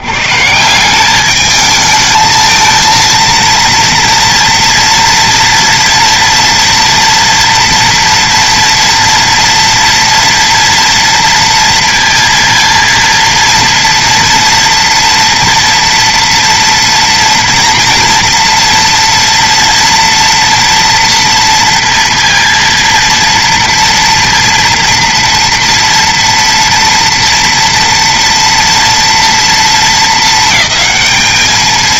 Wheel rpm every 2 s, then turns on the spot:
120, 220, 230, 230, 230, 230, 230, 230, 230, 230, 230, 230, 230, 230, 230, 220.
none